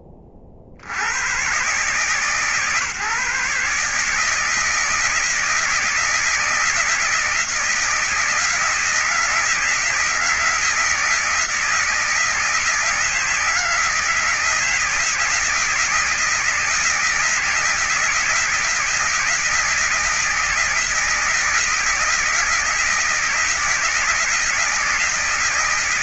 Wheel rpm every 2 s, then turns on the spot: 40, 140, 150, 160, 160, 160, 160, 160, 160, 160, 160, 160, 160.
none